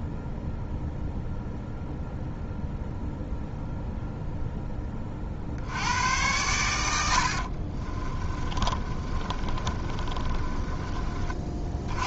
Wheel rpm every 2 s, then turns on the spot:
0, 0, 20, 90, 30, 30.
8-12